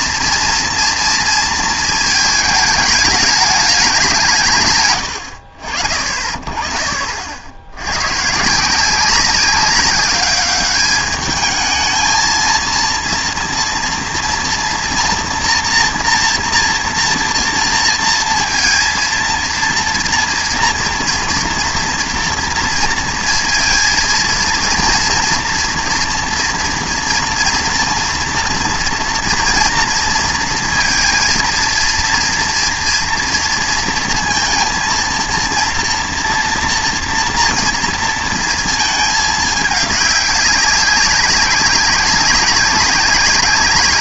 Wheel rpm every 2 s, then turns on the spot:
230, 210, 150, 40, 160, 200, 230, 230, 230, 230, 230, 230, 230, 230, 230, 230, 230, 230, 230, 230, 200, 190.
none